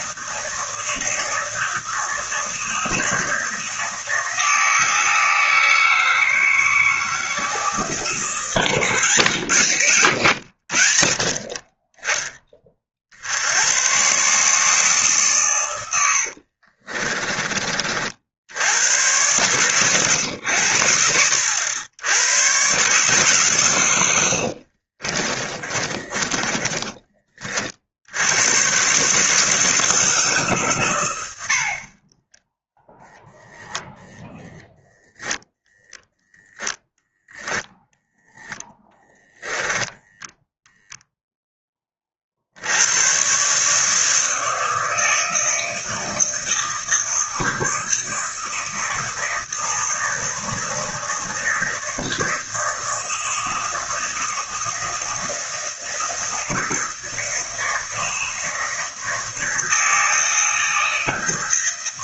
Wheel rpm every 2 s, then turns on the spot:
160, 160, 160, 160, 150, 60, 40, 150, 50, 90, 90, 130, 50, 20, 130, 120, 0, 0, 0, 0, 0, 90, 160, 160, 160, 160, 160, 160, 160, 160, 160.
16-18 24-28